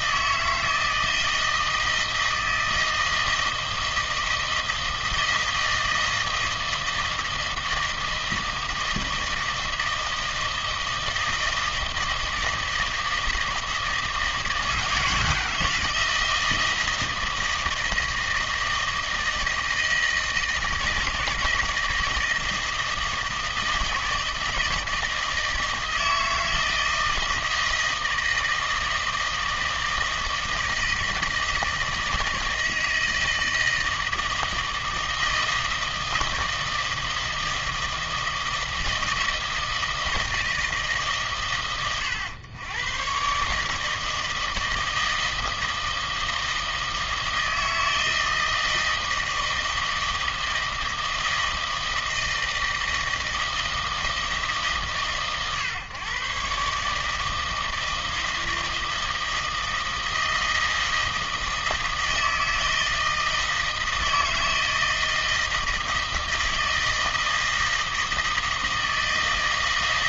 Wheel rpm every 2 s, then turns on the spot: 160, 160, 160, 160, 160, 160, 160, 160, 170, 160, 160, 160, 160, 160, 160, 160, 160, 160, 160, 160, 150, 110, 160, 160, 160, 160, 160, 150, 140, 160, 160, 160, 160, 160, 160.
none